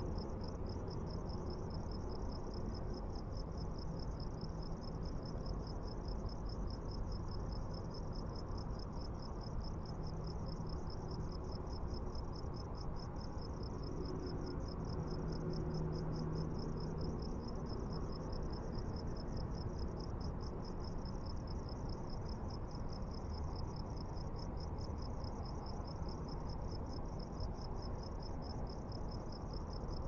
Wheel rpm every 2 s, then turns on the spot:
0, 0, 0, 0, 0, 0, 0, 0, 0, 0, 0, 0, 0, 0, 0.
none